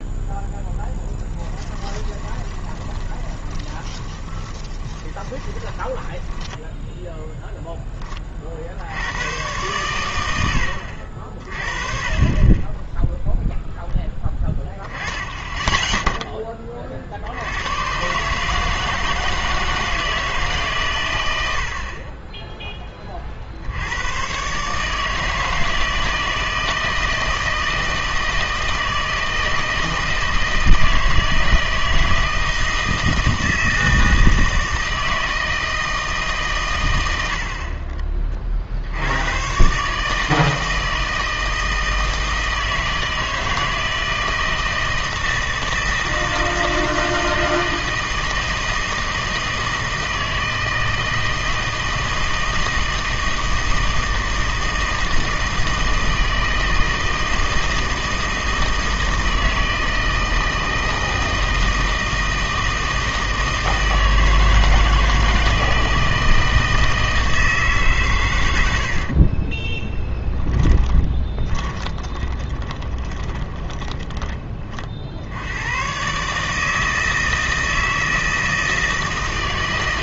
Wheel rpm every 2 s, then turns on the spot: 10, 20, 20, 10, 60, 90, 20, 10, 30, 160, 140, 20, 140, 160, 160, 160, 160, 160, 110, 60, 160, 160, 160, 160, 160, 160, 160, 160, 160, 160, 160, 160, 160, 160, 80, 20, 20, 30, 150, 160.
2-8 70-74